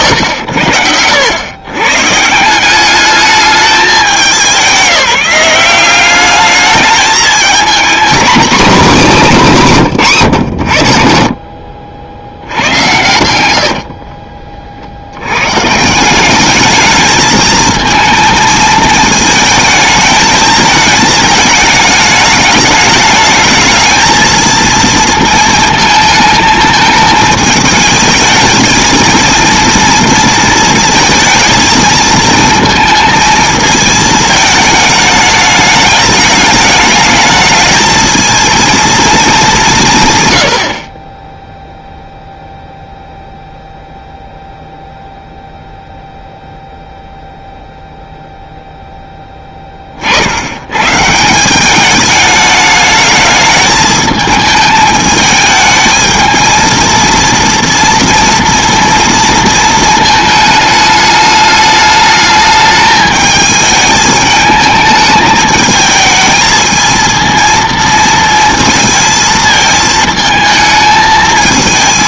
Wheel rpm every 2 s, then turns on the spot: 90, 200, 180, 210, 250, 90, 100, 60, 210, 220, 220, 210, 230, 220, 220, 230, 220, 210, 210, 230, 80, 0, 0, 0, 0, 100, 210, 220, 230, 230, 220, 210, 220, 230, 230, 220.
none